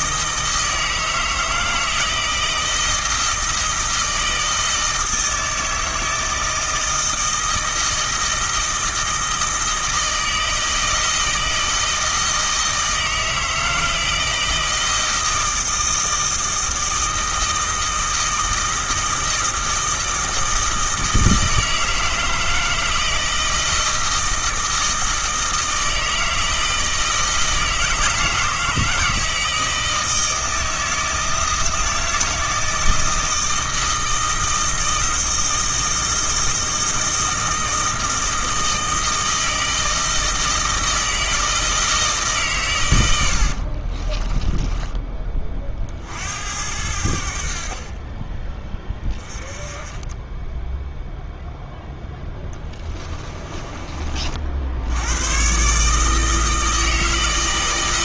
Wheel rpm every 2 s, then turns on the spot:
160, 160, 160, 160, 160, 160, 160, 160, 160, 160, 160, 160, 160, 160, 160, 160, 160, 160, 160, 160, 160, 110, 20, 80, 20, 0, 10, 80, 160.
52-54